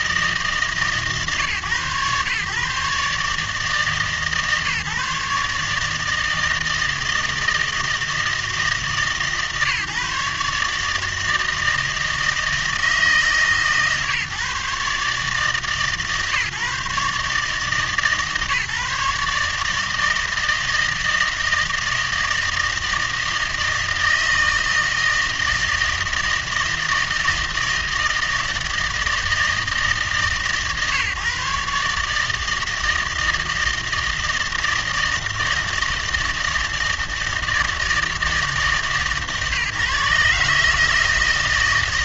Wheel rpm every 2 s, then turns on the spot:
150, 140, 150, 160, 160, 150, 160, 150, 150, 150, 160, 160, 160, 160, 160, 130, 160, 160, 160, 150, 150.
none